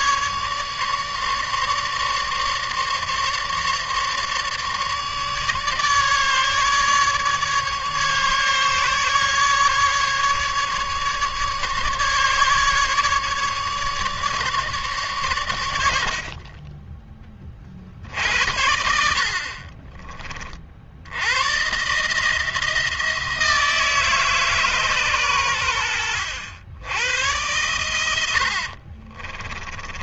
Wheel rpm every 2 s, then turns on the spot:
150, 150, 150, 150, 150, 150, 150, 150, 30, 70, 50, 160, 140, 90, 70.
28-30